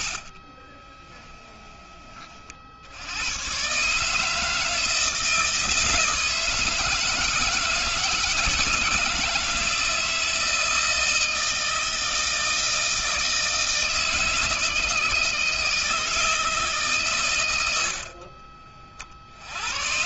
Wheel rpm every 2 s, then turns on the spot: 20, 100, 160, 160, 160, 160, 160, 160, 130, 40.
none